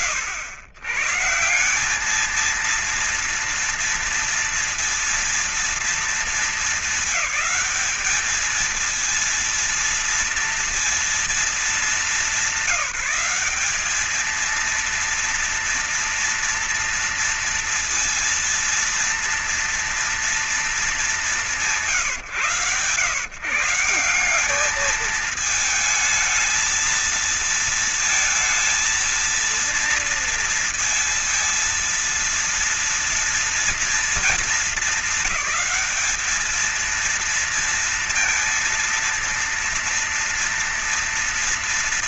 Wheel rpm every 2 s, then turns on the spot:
120, 220, 230, 220, 220, 230, 210, 220, 230, 230, 210, 110, 200, 220, 230, 230, 230, 220, 220, 230, 230.
none